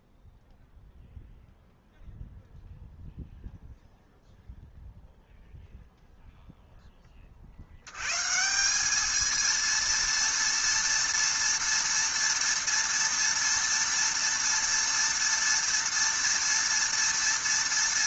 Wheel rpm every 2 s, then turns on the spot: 0, 0, 0, 0, 170, 230, 230, 230, 230.
none